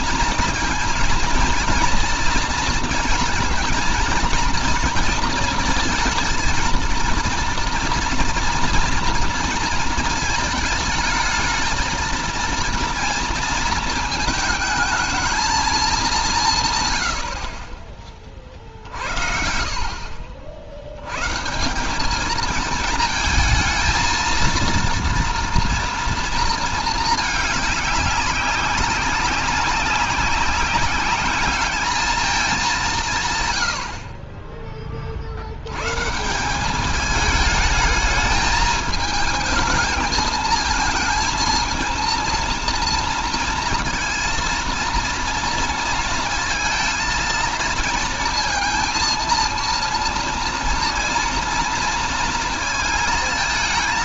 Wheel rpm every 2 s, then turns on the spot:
220, 230, 230, 220, 240, 220, 230, 220, 170, 40, 70, 220, 230, 230, 200, 200, 200, 20, 170, 220, 220, 230, 230, 220, 230, 230, 230.
none